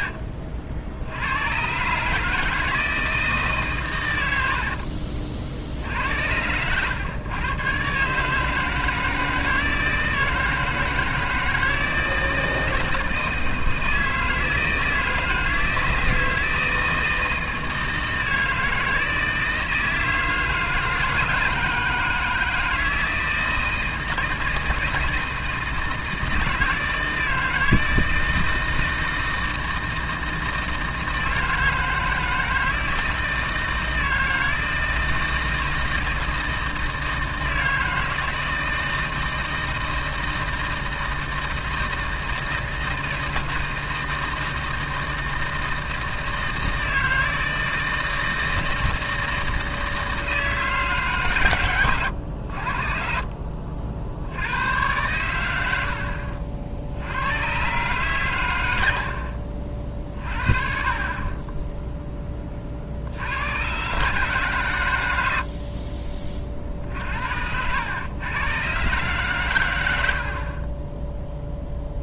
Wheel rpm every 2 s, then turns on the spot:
70, 160, 60, 100, 160, 160, 160, 160, 160, 160, 160, 160, 160, 160, 160, 160, 160, 160, 160, 160, 160, 160, 160, 160, 160, 150, 60, 100, 60, 90, 30, 40, 130, 50, 130, 30.
4-6